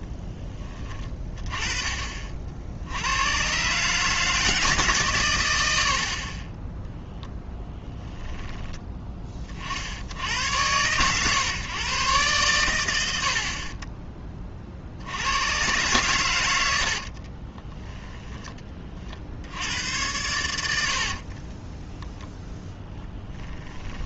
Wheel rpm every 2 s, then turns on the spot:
20, 70, 140, 10, 10, 110, 100, 40, 80, 30, 70, 10.
6-8 22-24